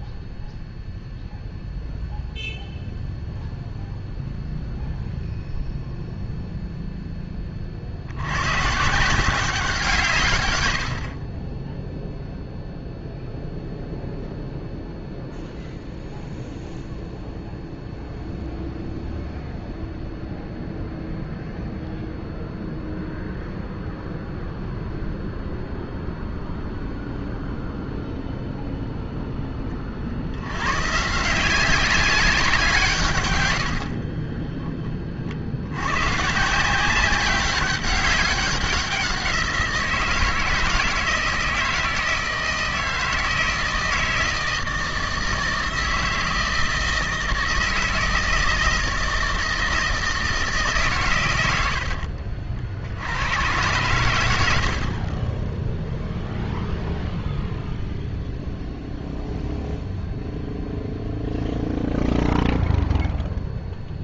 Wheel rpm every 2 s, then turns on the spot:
0, 0, 0, 0, 150, 80, 0, 0, 0, 0, 0, 0, 0, 0, 0, 130, 140, 30, 180, 180, 160, 160, 160, 160, 160, 130, 80, 60, 0, 0, 0, 0.
10-12 54-56